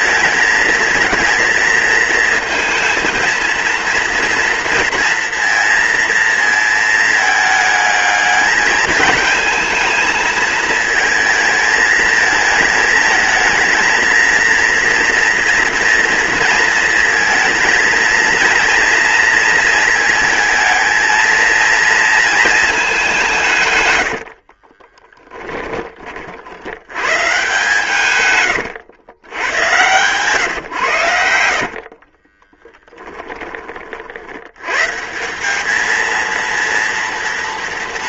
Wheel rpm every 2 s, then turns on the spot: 230, 230, 230, 220, 220, 220, 220, 230, 230, 230, 220, 190, 20, 110, 100, 90, 20, 150, 230.
24-26 32-34